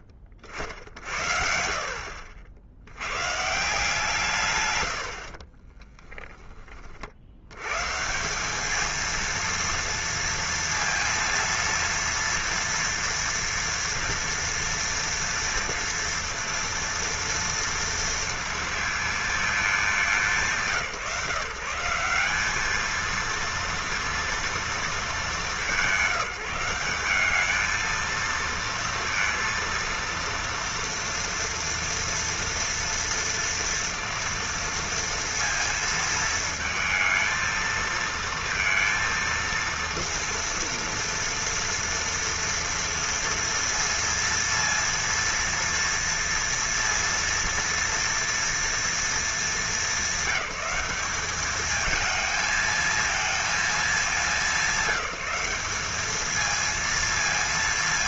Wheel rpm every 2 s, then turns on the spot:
40, 70, 110, 20, 210, 230, 230, 230, 230, 230, 170, 210, 220, 170, 230, 230, 230, 230, 220, 230, 230, 230, 230, 230, 230, 190, 220, 200, 230.
none